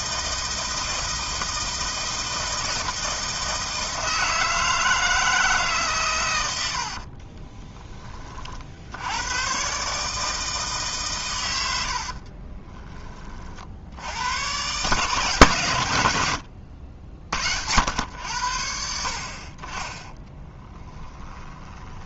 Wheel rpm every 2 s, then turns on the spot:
160, 160, 160, 70, 70, 150, 30, 140, 80, 70, 10.
6-8 20-22